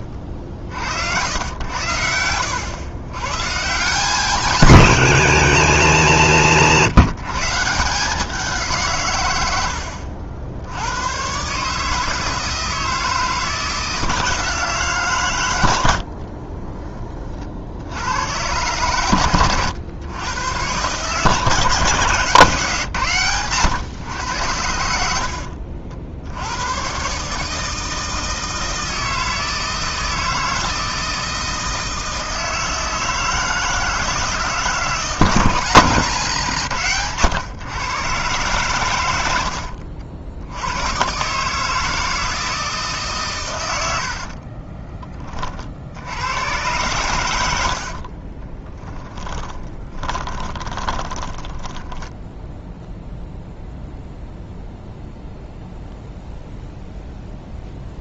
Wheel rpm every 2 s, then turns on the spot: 50, 100, 160, 110, 150, 100, 160, 150, 30, 110, 130, 140, 80, 120, 160, 160, 160, 160, 130, 110, 100, 150, 30, 110, 30, 20, 0, 0, 0.
16-18 24-26 44-46 48-52